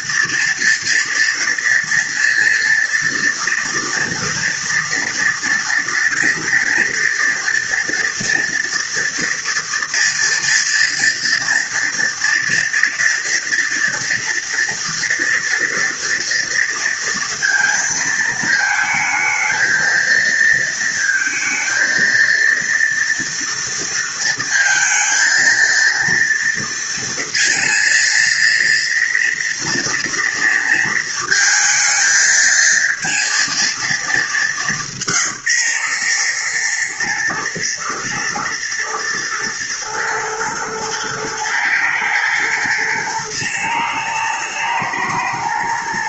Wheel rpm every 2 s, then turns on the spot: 230, 240, 230, 230, 230, 230, 240, 230, 230, 220, 230, 230, 230, 230, 240, 230, 230, 170, 110, 110, 110, 120, 110.
none